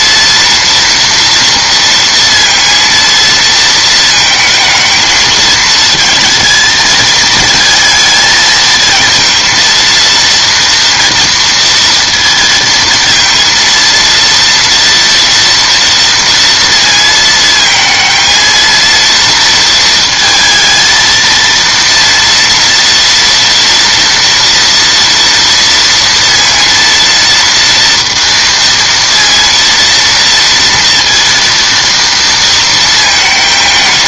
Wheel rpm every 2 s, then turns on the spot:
230, 230, 220, 220, 220, 230, 230, 230, 230, 230, 230, 230, 230, 230, 230, 230, 220.
none